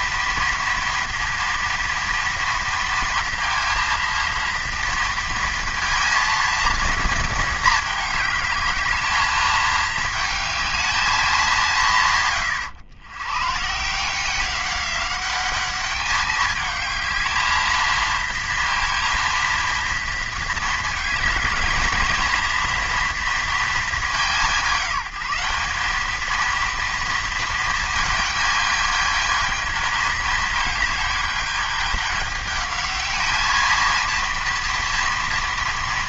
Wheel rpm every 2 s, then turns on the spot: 230, 230, 230, 220, 220, 210, 120, 200, 220, 230, 220, 230, 190, 230, 220, 210, 210, 230.
none